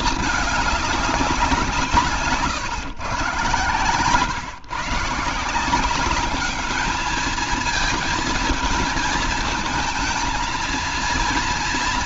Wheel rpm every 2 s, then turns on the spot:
190, 120, 150, 220, 220, 230.
none